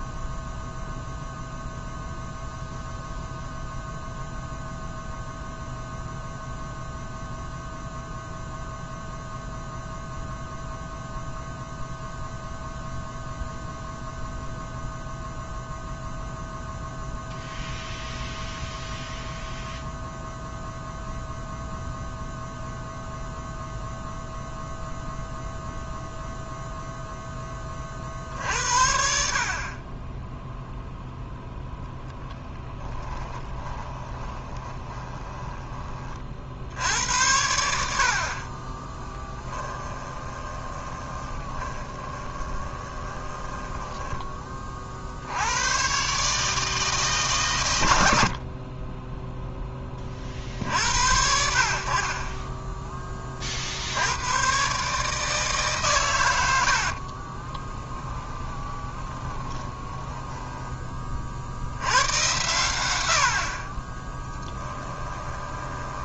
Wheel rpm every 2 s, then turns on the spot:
0, 0, 0, 0, 0, 0, 0, 0, 0, 0, 0, 0, 0, 0, 60, 0, 10, 20, 70, 30, 20, 20, 40, 160, 30, 90, 10, 130, 80, 20, 10, 110, 10.
32-36 38-44 56-60 64-66